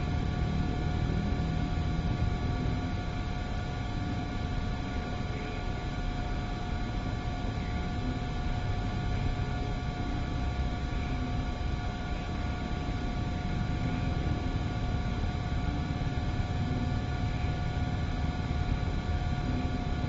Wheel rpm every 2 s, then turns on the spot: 0, 0, 0, 0, 0, 0, 0, 0, 0, 0.
none